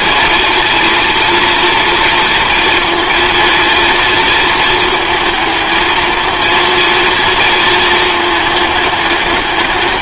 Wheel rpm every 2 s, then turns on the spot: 230, 230, 220, 230, 210.
none